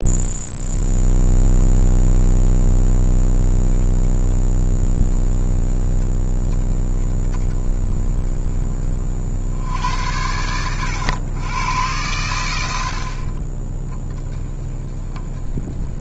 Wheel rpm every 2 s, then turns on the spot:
20, 10, 10, 10, 20, 100, 100, 10.
none